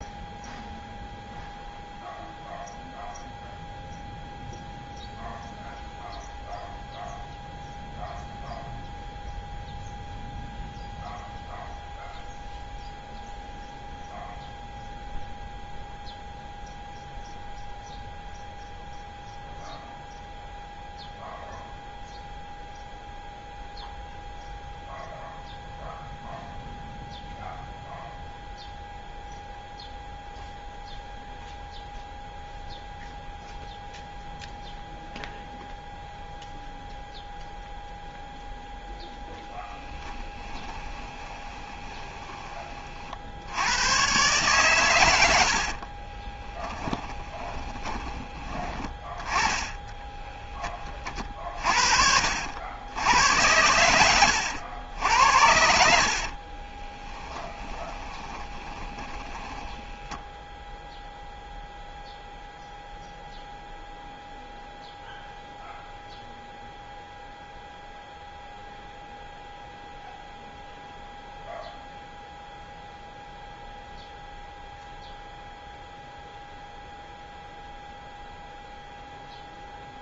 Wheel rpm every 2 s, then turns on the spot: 0, 0, 0, 0, 0, 0, 0, 0, 0, 0, 0, 0, 0, 0, 0, 0, 0, 0, 0, 0, 10, 30, 130, 20, 30, 10, 80, 90, 30, 20, 0, 0, 0, 0, 0, 0, 0, 0, 0, 0.
40-42 46-48 56-60